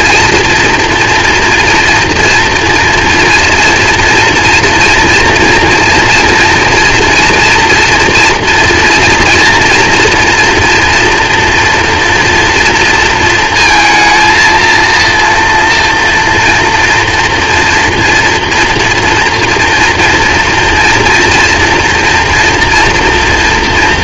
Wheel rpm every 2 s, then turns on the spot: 230, 230, 230, 230, 230, 230, 230, 230, 230, 240, 230, 240.
none